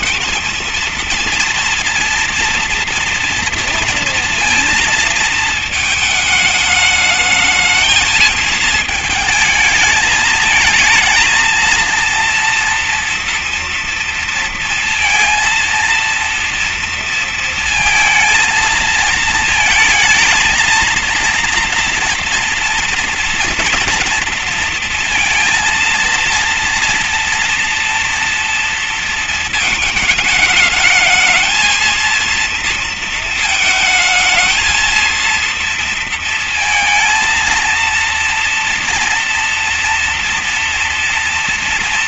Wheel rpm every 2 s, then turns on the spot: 230, 230, 230, 220, 220, 220, 230, 230, 230, 220, 230, 240, 240, 230, 240, 210, 230, 220, 230, 230, 230.
none